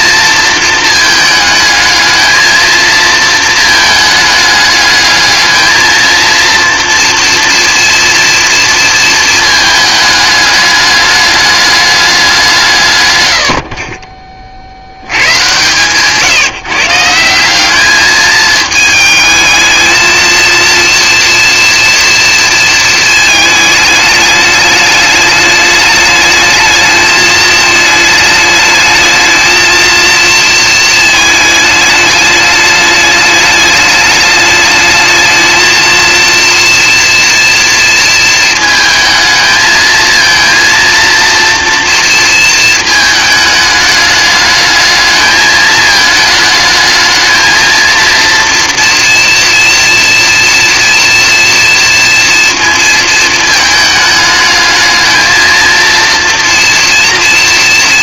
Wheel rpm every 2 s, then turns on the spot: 220, 220, 220, 230, 220, 210, 50, 130, 190, 220, 230, 220, 210, 220, 220, 220, 210, 220, 230, 220, 230, 210, 220, 220, 230, 230, 220, 230, 230.
none